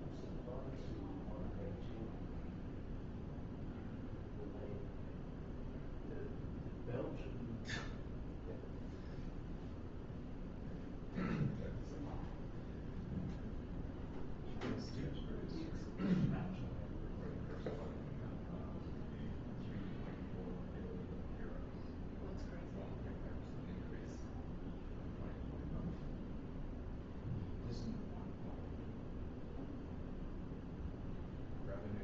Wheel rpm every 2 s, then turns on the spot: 0, 0, 0, 0, 0, 0, 0, 0, 0, 0, 0, 0, 0, 0, 0, 0.
none